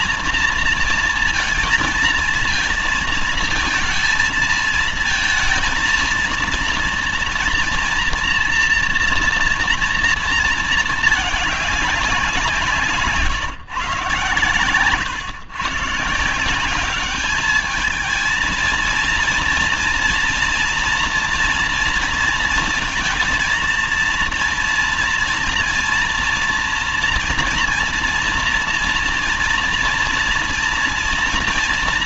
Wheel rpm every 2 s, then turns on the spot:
230, 230, 220, 230, 240, 230, 170, 130, 170, 220, 240, 230, 230, 230, 230, 230.
none